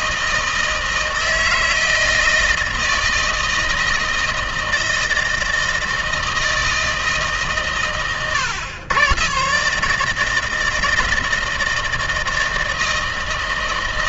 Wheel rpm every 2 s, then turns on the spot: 160, 160, 160, 160, 110, 160, 160.
none